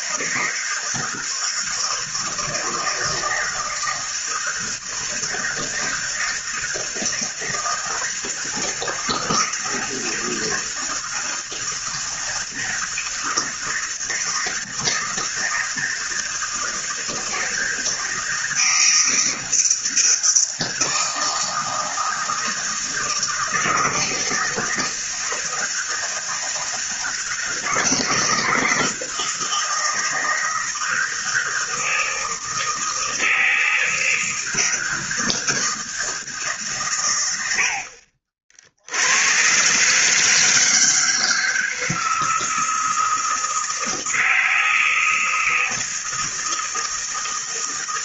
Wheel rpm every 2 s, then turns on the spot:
160, 160, 160, 160, 160, 160, 160, 160, 160, 160, 160, 160, 160, 160, 170, 160, 160, 160, 140, 60, 160, 160, 160, 160.
none